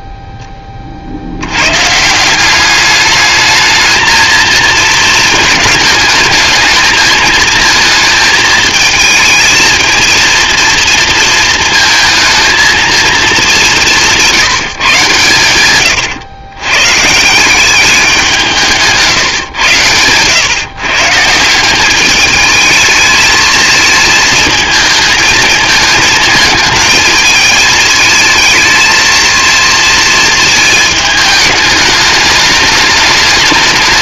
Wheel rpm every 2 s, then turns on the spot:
20, 190, 220, 220, 220, 230, 230, 170, 110, 170, 140, 220, 220, 220, 220, 220, 210.
none